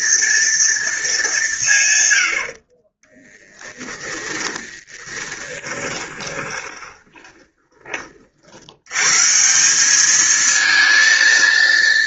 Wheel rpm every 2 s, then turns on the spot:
230, 110, 20, 20, 40, 210.
4-8